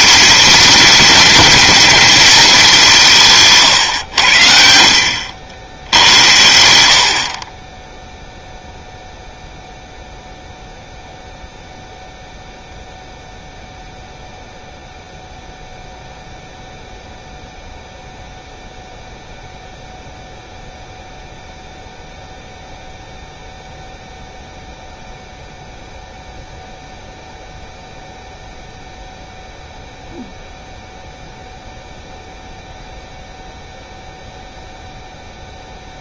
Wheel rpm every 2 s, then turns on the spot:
230, 180, 60, 80, 0, 0, 0, 0, 0, 0, 0, 0, 0, 0, 0, 0, 0, 0.
none